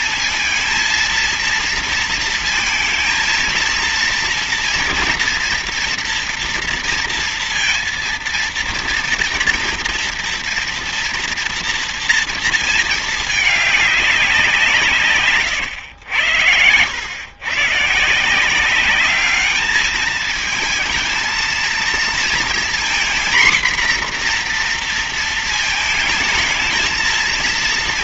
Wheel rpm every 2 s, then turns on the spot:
230, 230, 240, 230, 230, 230, 230, 170, 110, 180, 220, 230, 240, 220.
none